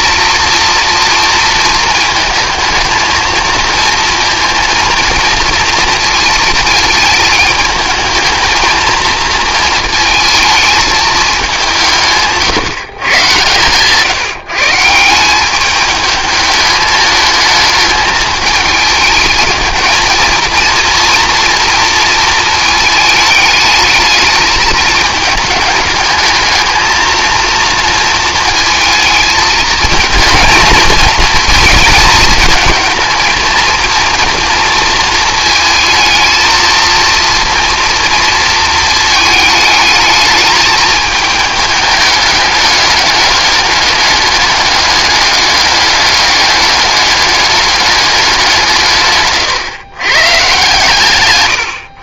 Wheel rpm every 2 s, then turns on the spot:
230, 220, 230, 230, 230, 220, 140, 150, 210, 210, 230, 220, 220, 220, 230, 230, 220, 230, 230, 230, 220, 210, 200, 210, 180, 130.
none